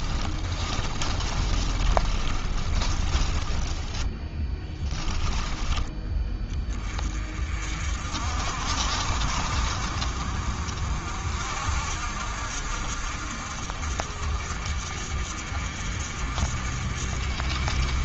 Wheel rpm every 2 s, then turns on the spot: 30, 30, 10, 30, 50, 50, 60, 50, 50.
0-6